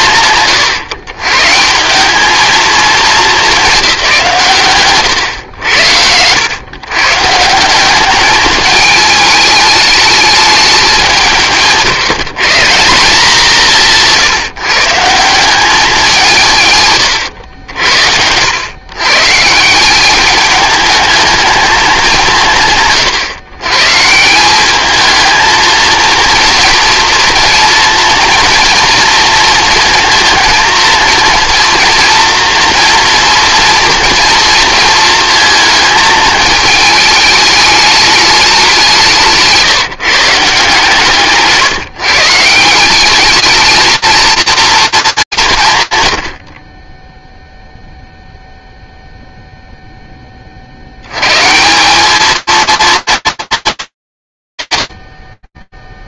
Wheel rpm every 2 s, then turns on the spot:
120, 210, 130, 130, 210, 190, 170, 150, 130, 120, 220, 120, 210, 230, 230, 230, 230, 230, 220, 190, 160, 190, 220, 20, 0, 110, 220, 50.
none